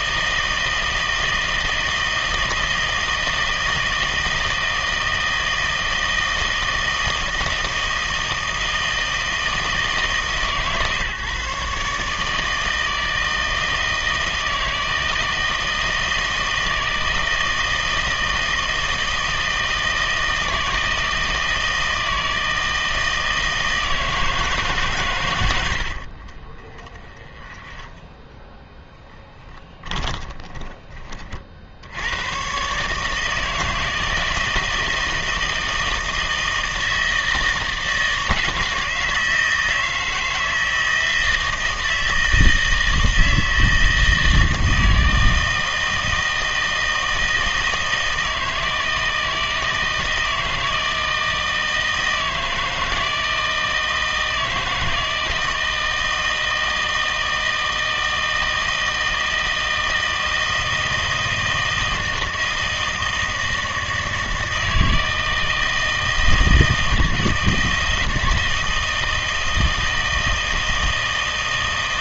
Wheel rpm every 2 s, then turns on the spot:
160, 160, 160, 160, 160, 140, 160, 160, 160, 160, 160, 160, 150, 30, 0, 20, 130, 160, 160, 160, 160, 160, 160, 160, 160, 160, 160, 160, 160, 160, 160, 160, 160, 160, 160, 160.
26-28